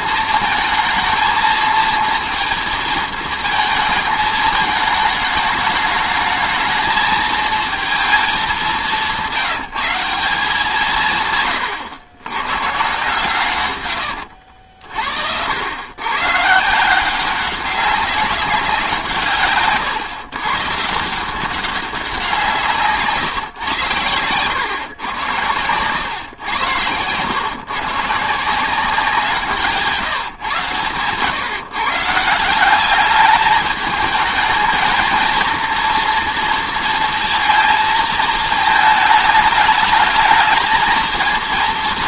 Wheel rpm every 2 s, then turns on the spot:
220, 230, 220, 220, 200, 180, 130, 60, 150, 180, 150, 160, 110, 110, 170, 130, 170, 220, 230, 220, 220.
14-16